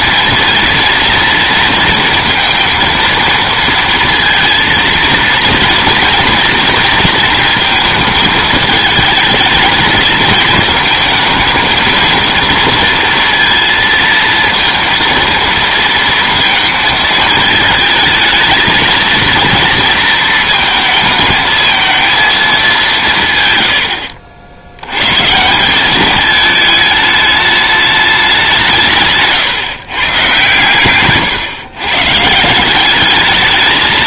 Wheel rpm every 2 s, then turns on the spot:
230, 230, 230, 230, 220, 220, 230, 230, 220, 220, 220, 180, 90, 210, 170, 140, 190.
none